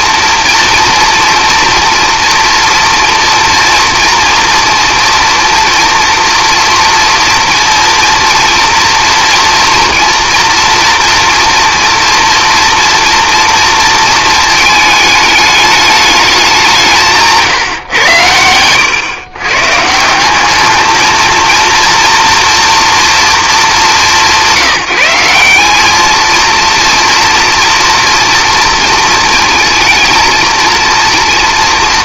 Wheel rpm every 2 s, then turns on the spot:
240, 240, 230, 230, 230, 230, 230, 220, 170, 120, 220, 240, 180, 230, 230, 230.
none